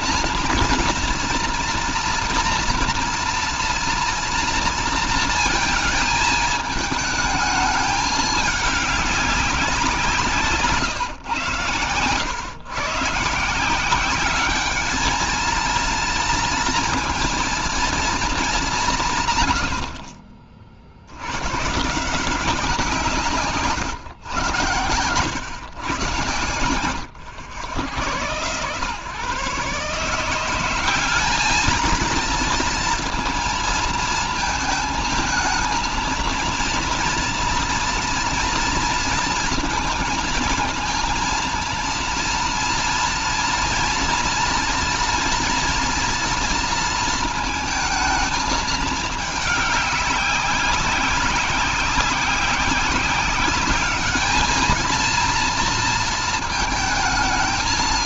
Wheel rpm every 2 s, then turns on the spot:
230, 230, 230, 210, 200, 120, 130, 210, 230, 160, 70, 170, 110, 110, 130, 190, 230, 220, 230, 230, 220, 230, 230, 230, 220, 200, 200, 220, 230.
none